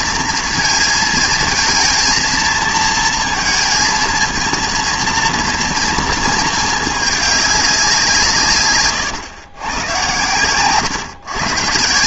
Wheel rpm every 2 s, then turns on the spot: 230, 230, 230, 220, 140, 130.
10-12